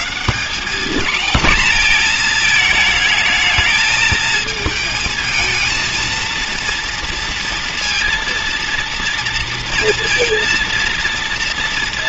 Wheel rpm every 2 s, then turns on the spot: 190, 230, 220, 240, 230, 230.
none